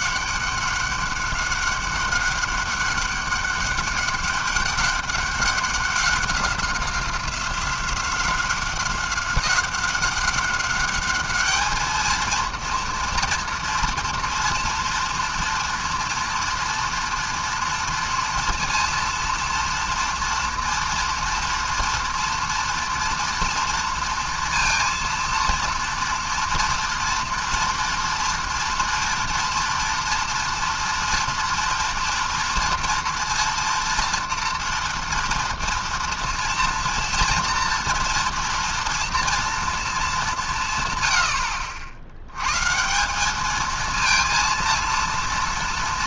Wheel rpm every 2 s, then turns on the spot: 200, 200, 200, 190, 190, 200, 230, 230, 230, 230, 230, 230, 230, 230, 230, 230, 230, 240, 230, 230, 160, 120, 230.
none